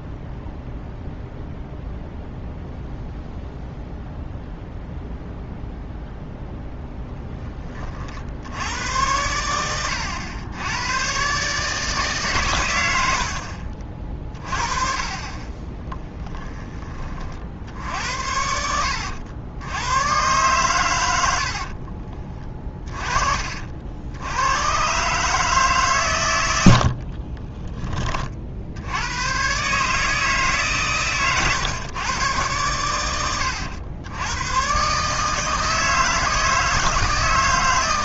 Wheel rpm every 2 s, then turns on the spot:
0, 0, 0, 10, 90, 100, 100, 40, 20, 80, 110, 30, 120, 70, 80, 140, 100, 130, 160.
26-28